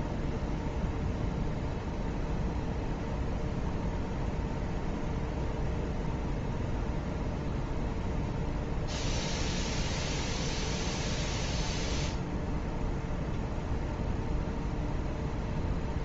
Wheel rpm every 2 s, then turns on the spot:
0, 0, 0, 0, 0, 0, 0, 0.
none